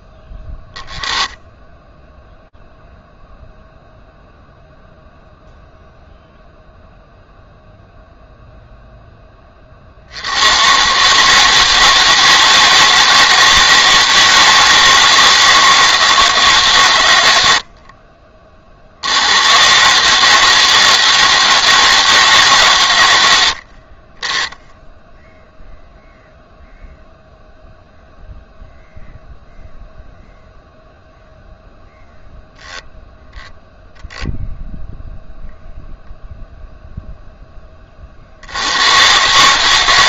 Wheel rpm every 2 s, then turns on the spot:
20, 0, 0, 0, 0, 130, 160, 160, 120, 80, 160, 110, 10, 0, 0, 0, 0, 0, 10, 140.
none